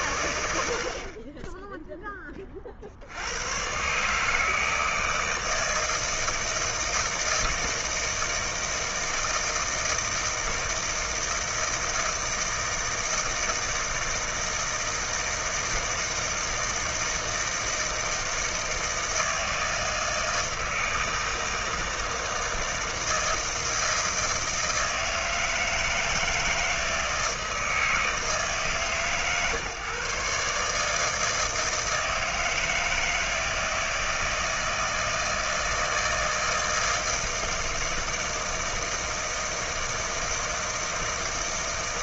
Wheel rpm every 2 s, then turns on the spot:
70, 40, 160, 160, 160, 160, 160, 160, 160, 160, 160, 160, 160, 160, 140, 150, 160, 160, 160, 160, 160.
none